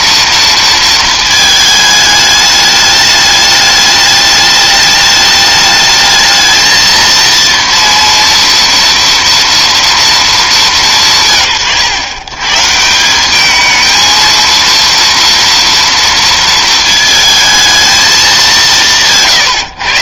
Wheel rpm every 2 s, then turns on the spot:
230, 210, 210, 220, 240, 190, 150, 230, 230, 180.
none